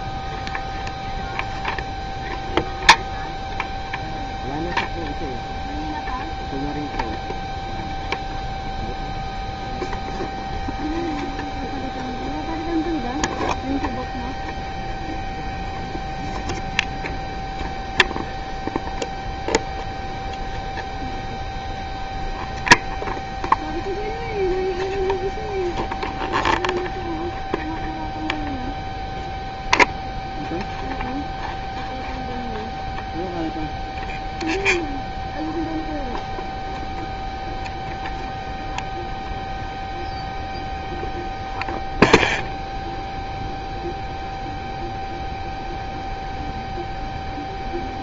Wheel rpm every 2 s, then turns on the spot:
0, 0, 0, 0, 0, 0, 0, 0, 0, 0, 0, 0, 0, 0, 0, 0, 0, 0, 0, 0, 0, 0, 0, 0.
none